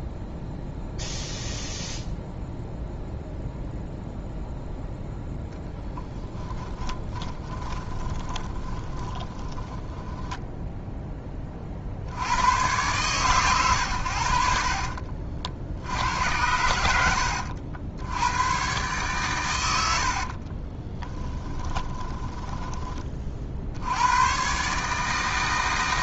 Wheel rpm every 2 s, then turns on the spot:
0, 0, 0, 10, 30, 0, 100, 50, 80, 120, 20, 20, 140.
6-10 14-16 20-22